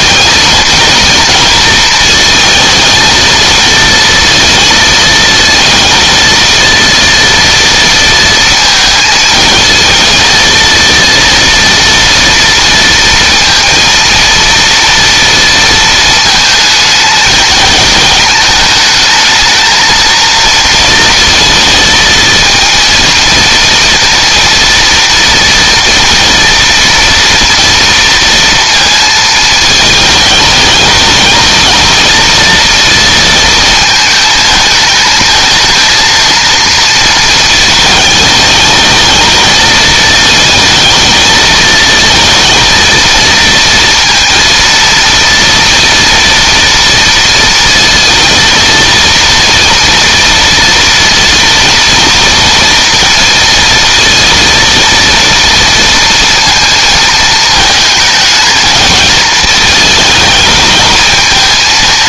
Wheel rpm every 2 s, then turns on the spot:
230, 230, 230, 230, 220, 230, 230, 230, 220, 220, 230, 230, 230, 230, 230, 220, 230, 220, 230, 220, 220, 230, 230, 230, 230, 230, 230, 230, 220, 220, 220.
none